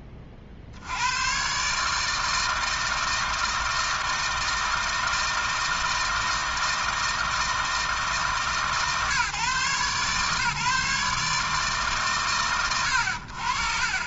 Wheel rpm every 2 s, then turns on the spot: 80, 160, 160, 160, 140, 150, 100.
none